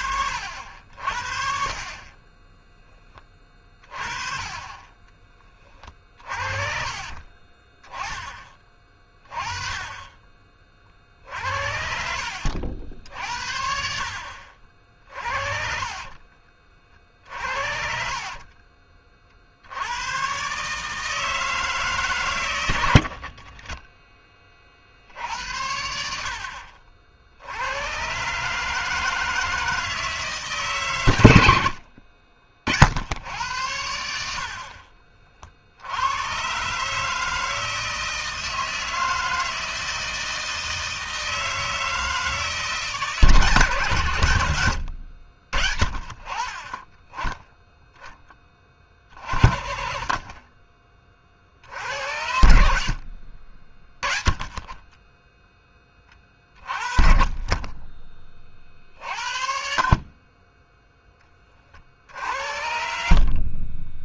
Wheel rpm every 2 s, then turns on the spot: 70, 10, 30, 40, 20, 40, 70, 60, 30, 40, 140, 100, 40, 60, 150, 140, 50, 50, 140, 160, 160, 160, 100, 30, 20, 20, 70, 30, 30, 40, 10, 70.
6-8 14-16